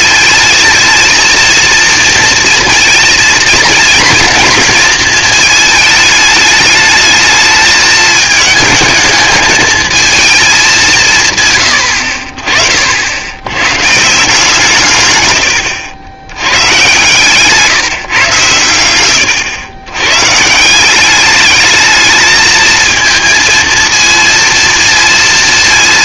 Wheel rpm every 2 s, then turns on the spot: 220, 230, 220, 220, 220, 210, 50, 150, 110, 120, 150, 220, 230.
none